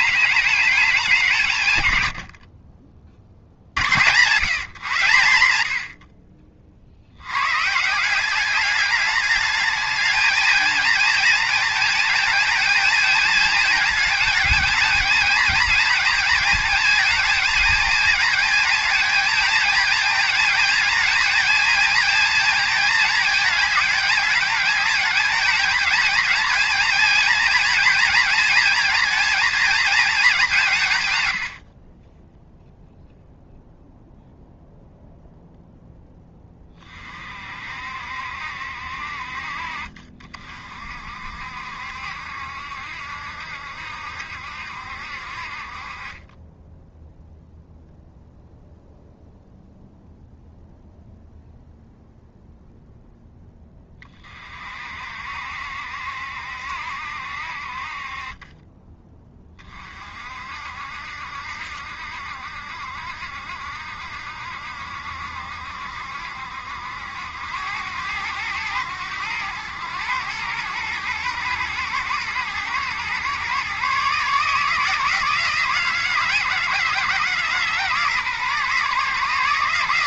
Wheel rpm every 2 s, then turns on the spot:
190, 40, 130, 60, 210, 230, 220, 220, 220, 220, 220, 220, 210, 220, 230, 160, 0, 0, 30, 60, 50, 70, 60, 10, 0, 0, 0, 50, 70, 20, 60, 70, 70, 70, 100, 110, 120, 160, 150, 140.
none